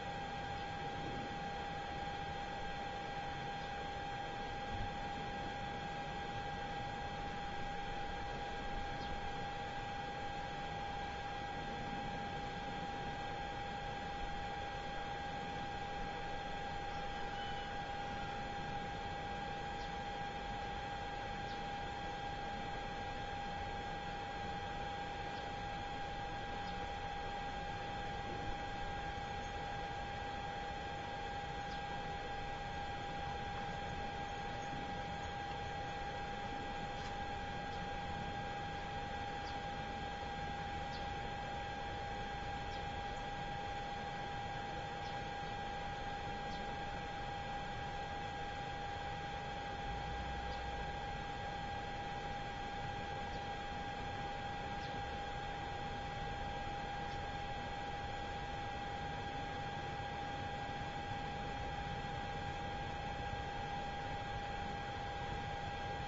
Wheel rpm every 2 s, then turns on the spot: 0, 0, 0, 0, 0, 0, 0, 0, 0, 0, 0, 0, 0, 0, 0, 0, 0, 0, 0, 0, 0, 0, 0, 0, 0, 0, 0, 0, 0, 0, 0, 0, 0.
none